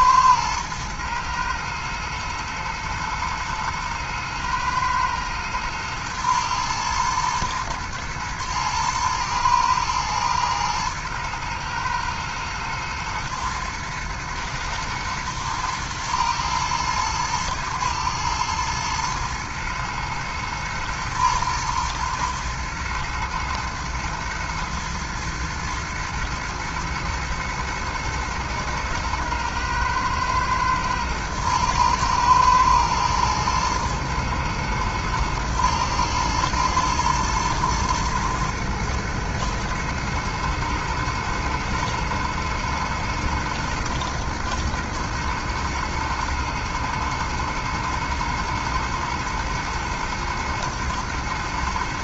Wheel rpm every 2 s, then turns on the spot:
110, 110, 110, 120, 110, 110, 110, 110, 110, 110, 110, 110, 110, 120, 110, 110, 110, 110, 110, 120, 120, 120, 120, 110, 110, 110.
none